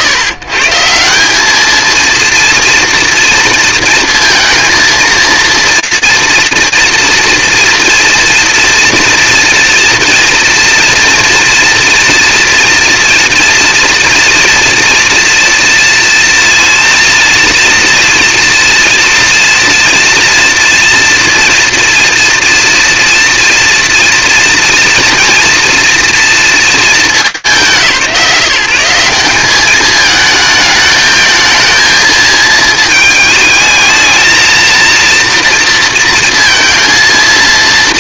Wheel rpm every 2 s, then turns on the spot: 150, 230, 230, 230, 230, 230, 240, 230, 230, 230, 230, 230, 230, 230, 160, 220, 220, 230, 230.
none